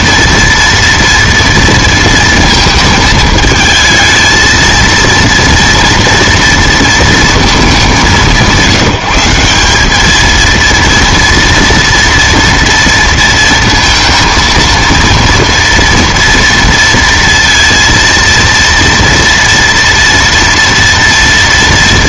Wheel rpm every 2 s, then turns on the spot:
230, 230, 230, 230, 170, 230, 230, 230, 230, 230, 230.
none